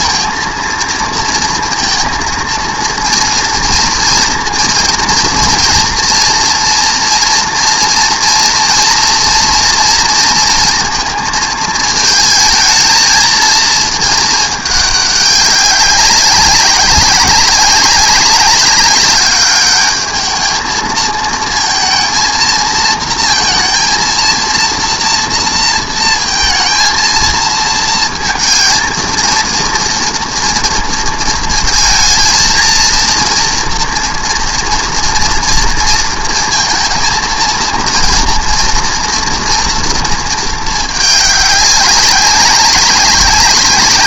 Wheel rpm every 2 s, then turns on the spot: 230, 230, 230, 230, 230, 220, 220, 200, 200, 210, 230, 230, 230, 220, 230, 220, 240, 230, 230, 220, 190, 190.
none